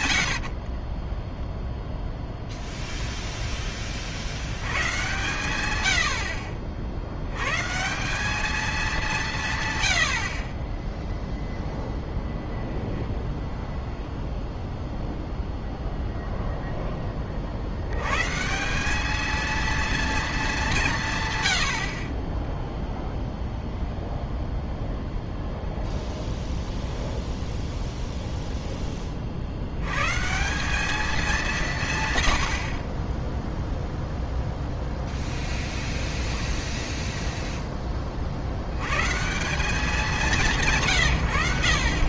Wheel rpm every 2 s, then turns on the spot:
60, 0, 100, 50, 210, 20, 0, 0, 0, 190, 200, 10, 0, 0, 10, 190, 40, 0, 10, 110, 170.
0-2 10-12 36-38